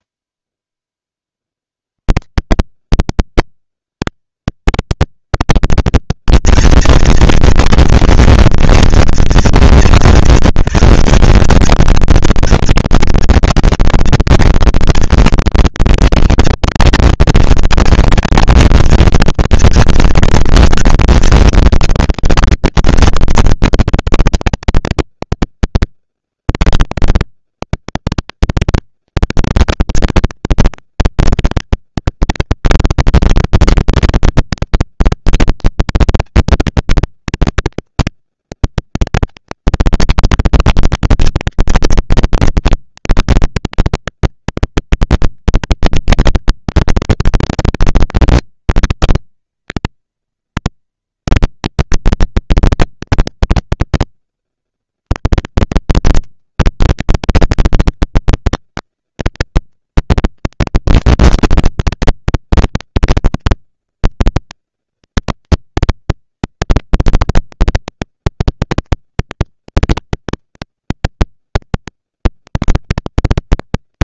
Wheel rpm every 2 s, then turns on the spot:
0, 80, 180, 210, 230, 160, 220, 230, 230, 230, 230, 220, 200, 120, 160, 220, 230, 230, 230, 230, 230, 230, 240, 240, 230, 230, 230, 230, 230, 230, 230, 220, 220, 230, 240, 230, 160.
none